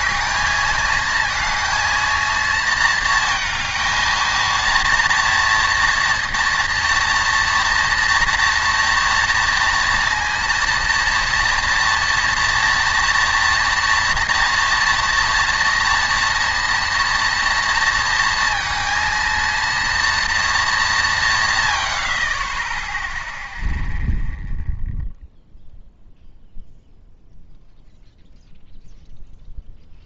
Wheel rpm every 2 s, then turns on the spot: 220, 230, 230, 230, 230, 230, 230, 230, 230, 230, 210, 10, 0, 0, 0.
none